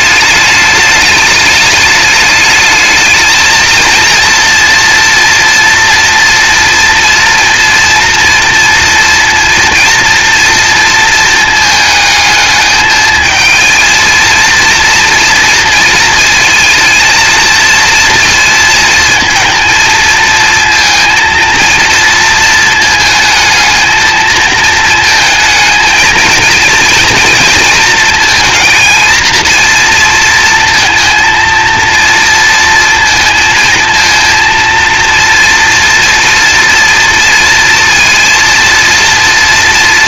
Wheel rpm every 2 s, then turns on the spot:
210, 210, 230, 230, 230, 230, 220, 230, 230, 220, 230, 220, 220, 230, 230, 230, 230, 230, 240, 230.
none